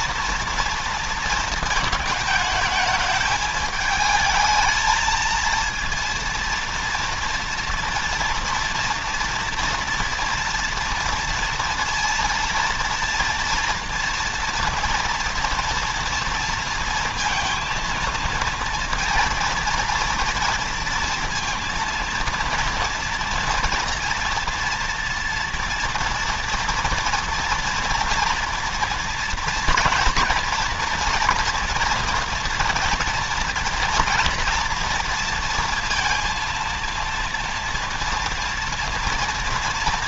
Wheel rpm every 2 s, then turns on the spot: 230, 210, 220, 230, 230, 230, 230, 240, 230, 230, 230, 230, 230, 230, 240, 240, 240, 230, 230, 230.
none